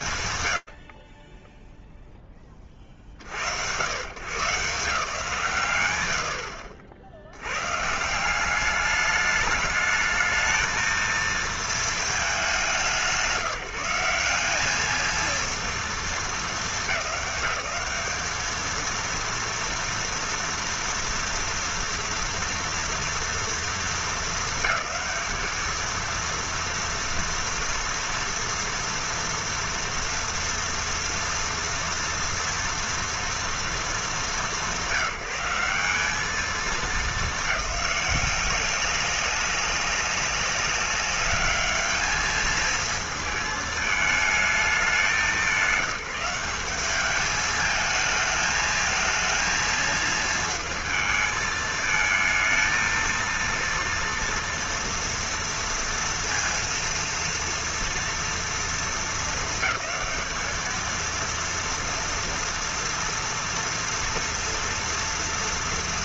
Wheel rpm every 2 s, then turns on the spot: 70, 160, 80, 210, 230, 160, 220, 180, 230, 230, 230, 220, 230, 230, 240, 230, 200, 180, 190, 190, 220, 220, 180, 220, 220, 220, 230, 230, 230, 220, 230, 230, 230.
none